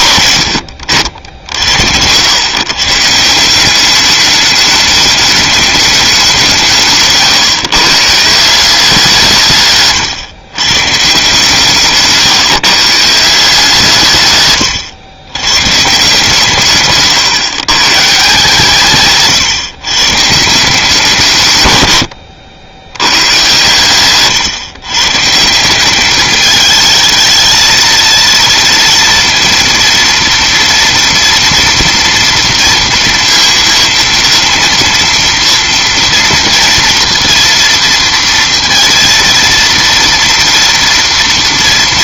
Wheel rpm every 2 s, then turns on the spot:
90, 130, 210, 170, 170, 140, 150, 130, 150, 150, 170, 90, 130, 220, 230, 230, 230, 230, 230, 230, 230.
none